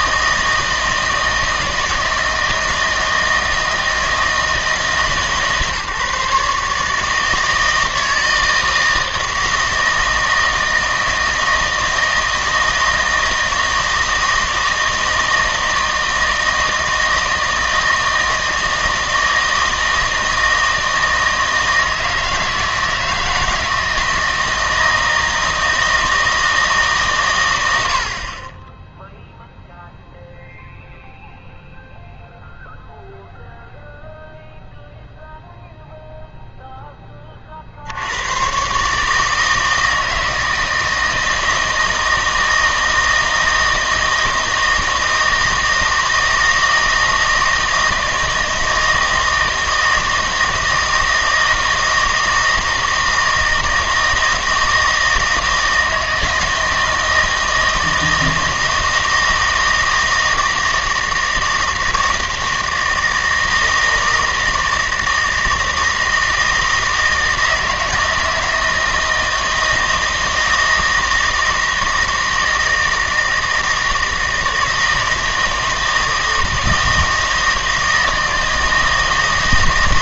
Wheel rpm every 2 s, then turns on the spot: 160, 160, 160, 150, 160, 160, 160, 160, 160, 160, 160, 160, 160, 150, 10, 0, 0, 0, 10, 130, 160, 160, 160, 160, 160, 160, 160, 160, 160, 160, 160, 160, 160, 160, 160, 160, 160, 160, 160, 160.
none